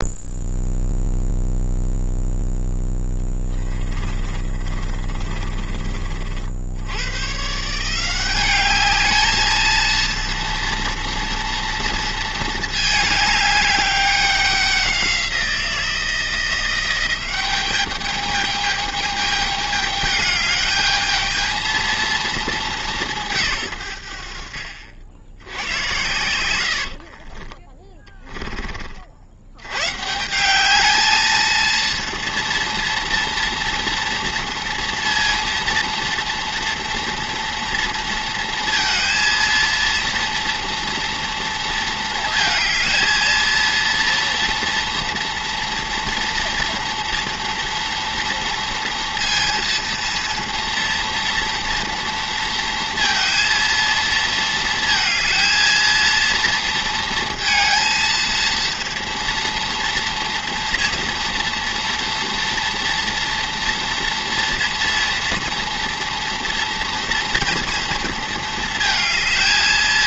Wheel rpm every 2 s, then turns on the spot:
0, 10, 20, 100, 210, 230, 210, 190, 180, 210, 220, 180, 80, 40, 50, 220, 230, 230, 230, 230, 230, 230, 230, 230, 230, 240, 230, 220, 230, 230, 230, 240, 230, 230, 220.
2-6 26-28